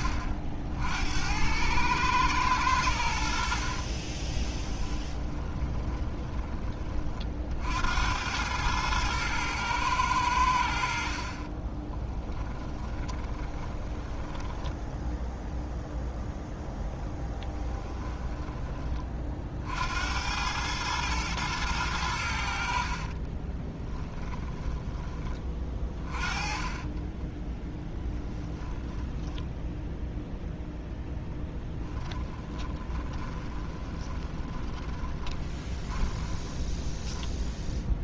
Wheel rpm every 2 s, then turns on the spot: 70, 90, 20, 30, 110, 70, 20, 10, 0, 20, 110, 60, 20, 30, 10, 0, 20, 20, 20.
4-6 12-16 22-24 26-30 32-38